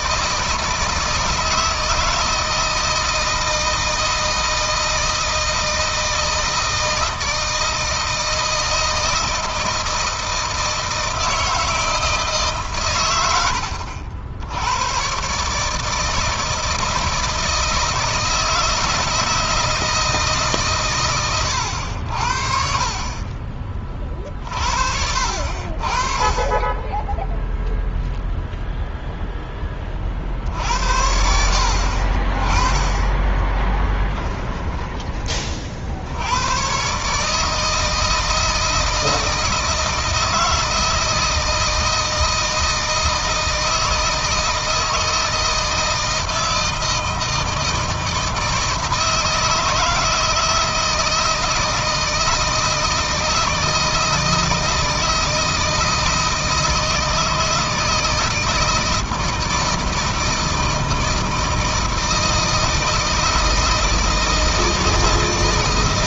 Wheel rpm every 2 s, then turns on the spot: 160, 170, 160, 160, 160, 160, 130, 100, 160, 170, 140, 50, 60, 20, 0, 80, 20, 30, 120, 160, 160, 160, 160, 160, 160, 160, 160, 160, 160, 160, 160, 160, 160.
26-28